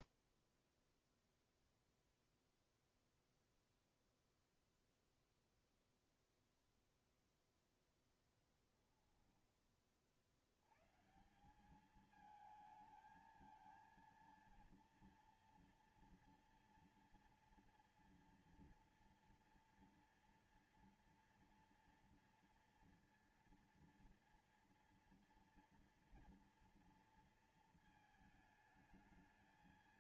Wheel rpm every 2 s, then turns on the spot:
0, 0, 0, 0, 10, 80, 220, 230, 230, 230, 230, 230, 230, 230, 220.
none